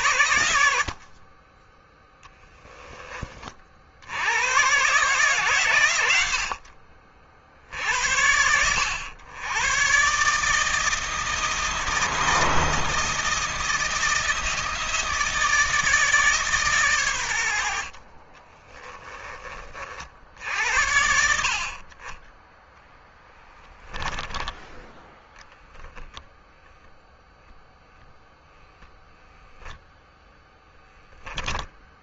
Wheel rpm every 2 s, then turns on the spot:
80, 10, 130, 60, 90, 160, 170, 160, 140, 20, 70, 10, 10, 0, 0, 10.
0-2 18-20 30-32